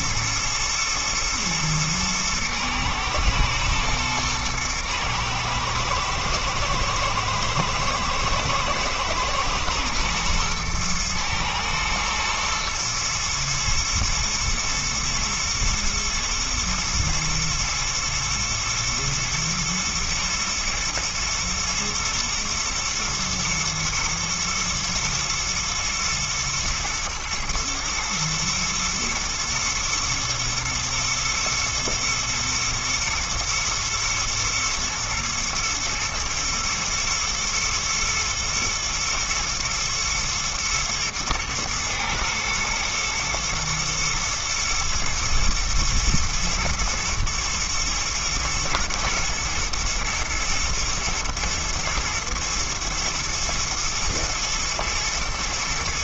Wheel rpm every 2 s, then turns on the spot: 120, 120, 120, 120, 110, 120, 120, 120, 110, 110, 110, 110, 110, 110, 120, 120, 120, 110, 110, 120, 110, 110, 110, 120, 120, 120, 120, 120.
none